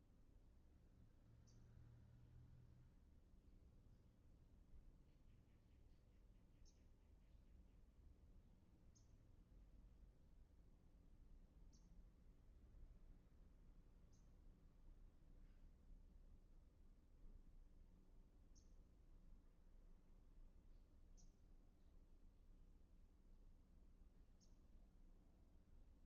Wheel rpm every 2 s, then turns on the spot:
0, 0, 0, 0, 0, 0, 0, 0, 0, 0, 0, 0, 0.
none